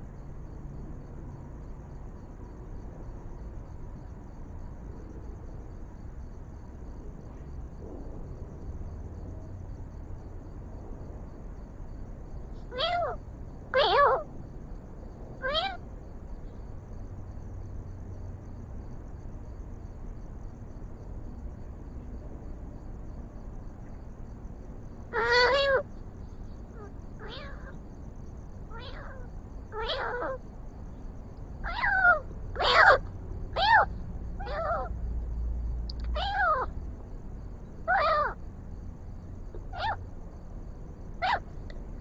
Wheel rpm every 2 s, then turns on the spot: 0, 0, 0, 0, 0, 0, 0, 0, 0, 0, 0, 0, 0, 0, 0, 0, 0, 0, 0, 0, 0.
none